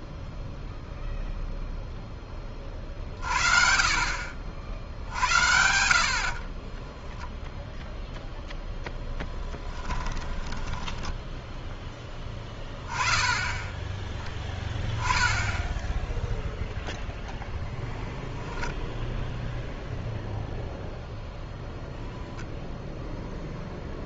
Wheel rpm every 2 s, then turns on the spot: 10, 50, 70, 0, 10, 10, 10, 0, 0, 0, 0, 0.
4-6 8-10